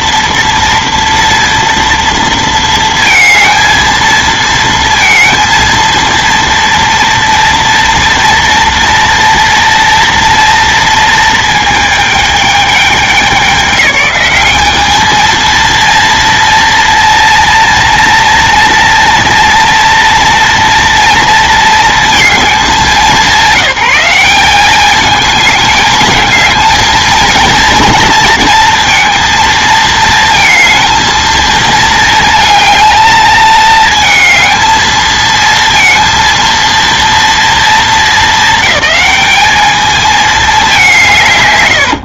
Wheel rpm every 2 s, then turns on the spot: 230, 230, 230, 230, 230, 230, 210, 210, 230, 240, 230, 210, 200, 220, 230, 230, 220, 220, 230, 220, 210.
none